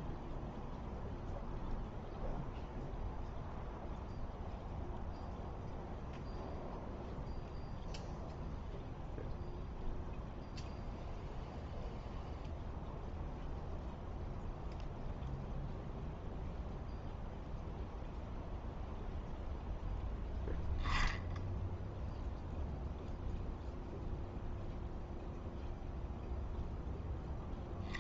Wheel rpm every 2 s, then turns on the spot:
0, 0, 0, 0, 0, 0, 0, 0, 0, 0, 0, 0, 0, 0.
none